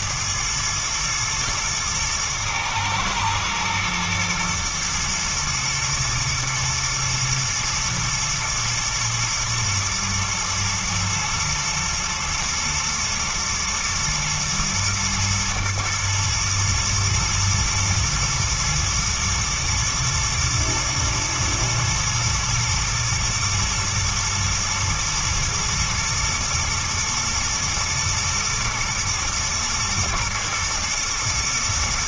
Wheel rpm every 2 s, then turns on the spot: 110, 110, 110, 120, 110, 110, 110, 120, 110, 110, 120, 110, 110, 110, 110, 110.
none